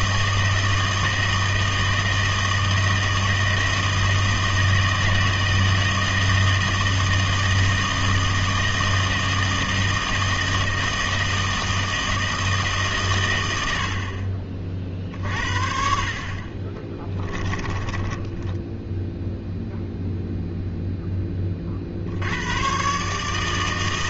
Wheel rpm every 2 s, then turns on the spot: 160, 160, 160, 160, 160, 160, 150, 40, 30, 10, 0, 120.
16-20